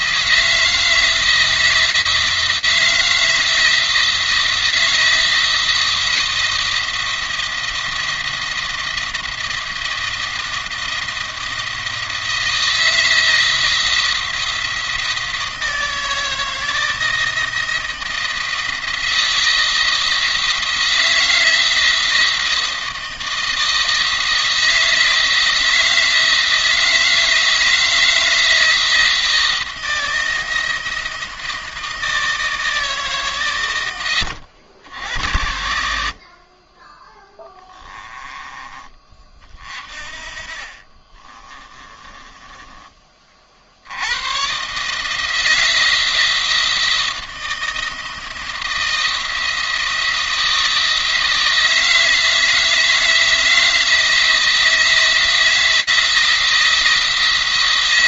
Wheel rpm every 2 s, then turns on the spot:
160, 170, 160, 170, 170, 170, 160, 160, 160, 170, 170, 160, 170, 160, 160, 170, 160, 90, 20, 30, 30, 20, 140, 170, 170, 170, 160, 160, 170.
36-38 40-42